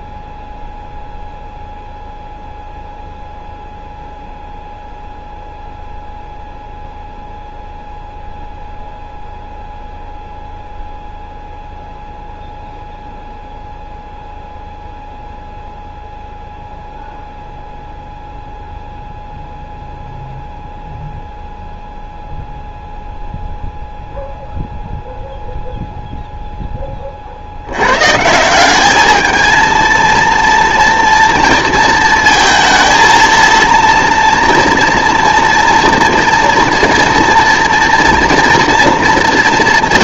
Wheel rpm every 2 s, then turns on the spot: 0, 0, 0, 0, 0, 0, 0, 0, 0, 0, 0, 0, 0, 0, 180, 240, 230, 240, 240, 240.
none